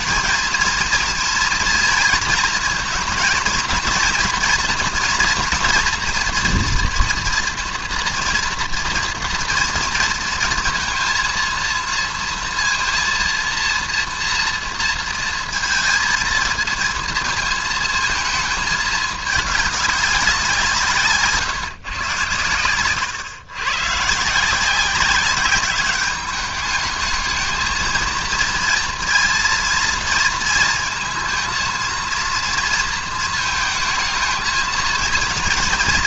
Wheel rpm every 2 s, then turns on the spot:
220, 220, 230, 230, 230, 230, 230, 230, 220, 220, 170, 110, 170, 210, 230, 220, 230, 220.
none